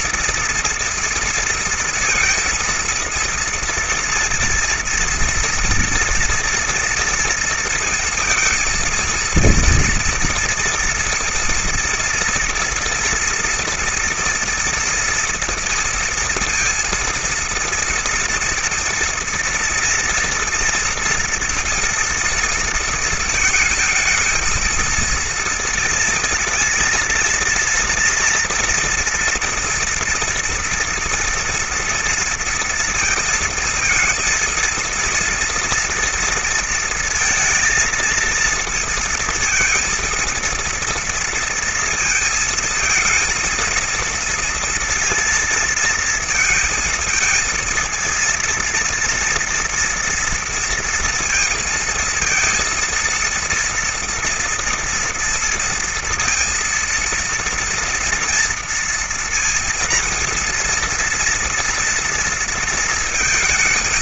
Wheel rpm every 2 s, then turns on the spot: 230, 230, 240, 240, 230, 230, 230, 230, 230, 230, 230, 230, 230, 230, 240, 230, 230, 230, 230, 230, 230, 220, 230, 220, 230, 230, 230, 230, 230, 230, 230, 230.
none